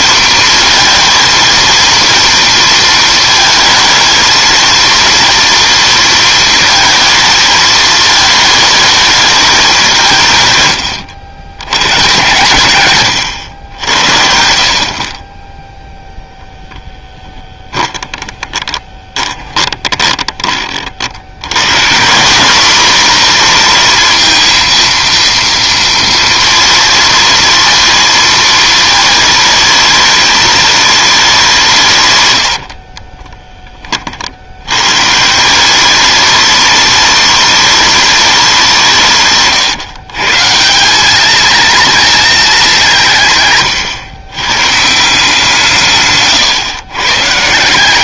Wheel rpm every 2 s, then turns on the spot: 230, 230, 230, 220, 220, 130, 120, 50, 10, 20, 30, 200, 230, 230, 220, 210, 110, 90, 210, 180, 170, 210, 140, 130.
16-20 32-34